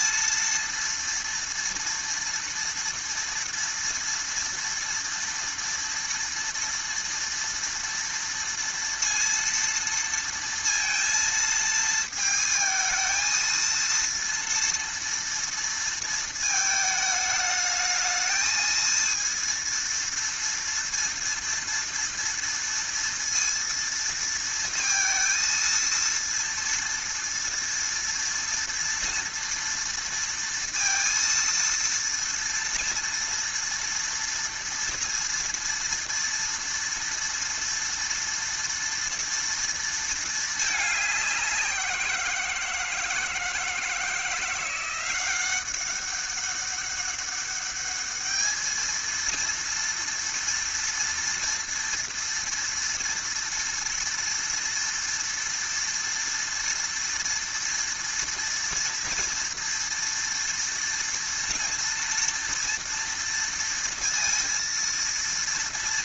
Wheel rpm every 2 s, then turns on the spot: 230, 230, 230, 230, 230, 230, 220, 230, 220, 220, 230, 230, 230, 230, 230, 230, 230, 230, 230, 230, 210, 160, 180, 200, 220, 230, 230, 230, 230, 230, 230, 230, 230.
none